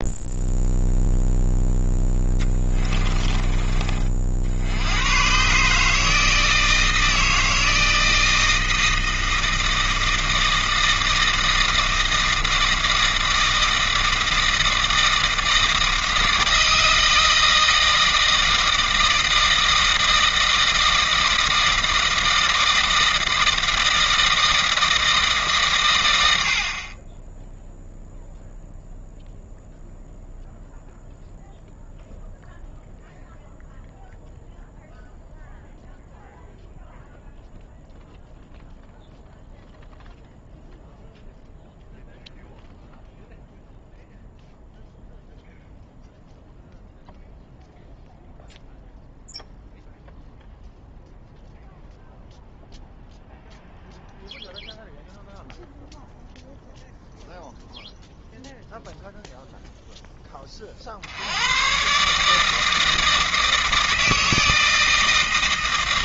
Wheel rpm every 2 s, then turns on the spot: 0, 20, 100, 160, 160, 160, 160, 160, 160, 160, 160, 160, 160, 30, 0, 0, 0, 0, 0, 0, 0, 0, 0, 0, 0, 0, 0, 0, 0, 0, 60, 160, 160.
2-4